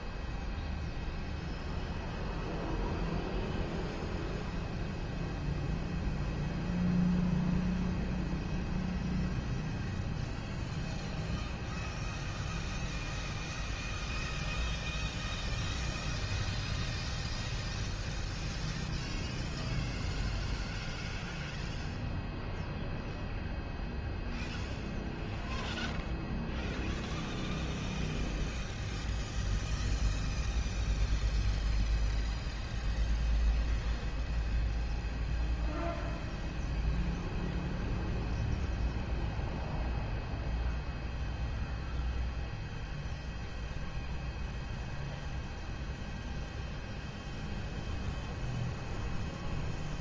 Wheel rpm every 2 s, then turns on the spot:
0, 0, 0, 0, 0, 0, 0, 0, 0, 0, 0, 0, 0, 0, 0, 0, 0, 0, 0, 0, 0, 0, 0, 0, 0.
none